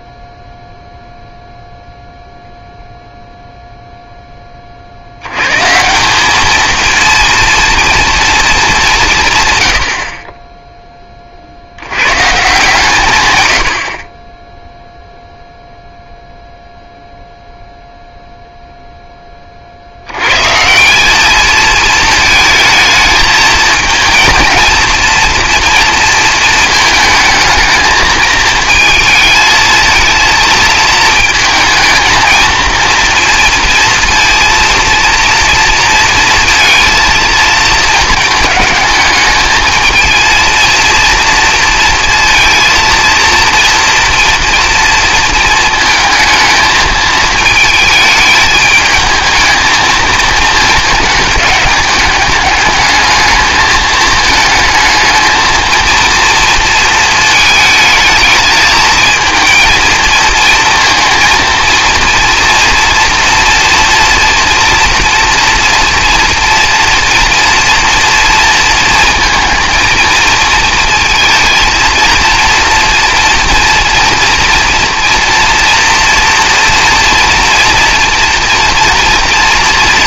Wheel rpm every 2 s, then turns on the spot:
0, 0, 30, 220, 210, 10, 150, 10, 0, 0, 160, 220, 230, 220, 220, 230, 230, 230, 230, 210, 230, 230, 230, 220, 210, 220, 210, 220, 230, 220, 230, 230, 240, 230, 230, 220, 230, 230, 230, 230.
none